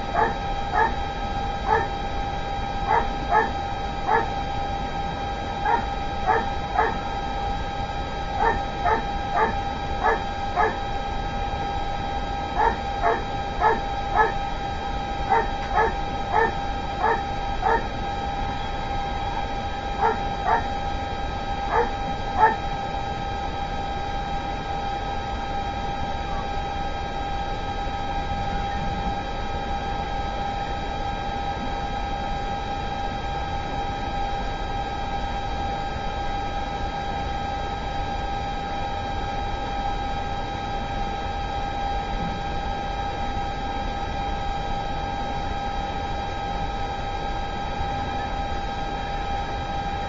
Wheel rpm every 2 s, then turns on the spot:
0, 0, 0, 0, 0, 0, 0, 0, 0, 0, 0, 0, 0, 0, 0, 0, 0, 0, 0, 0, 0, 0, 0, 0, 0.
none